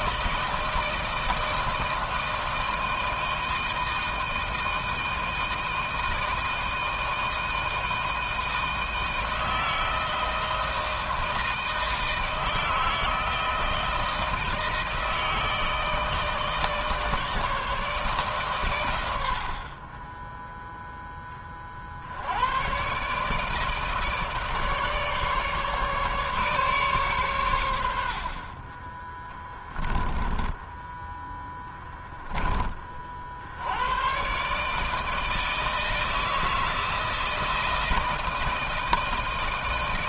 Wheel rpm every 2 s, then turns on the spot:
160, 160, 160, 160, 160, 160, 160, 160, 150, 100, 10, 130, 150, 130, 20, 10, 50, 160, 160, 160.
28-32